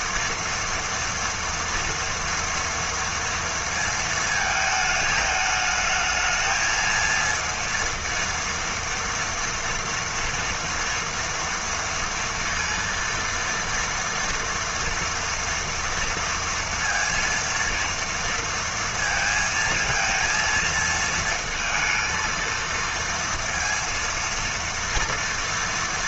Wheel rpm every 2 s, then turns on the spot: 230, 230, 220, 220, 230, 230, 230, 230, 230, 230, 220, 230, 230.
none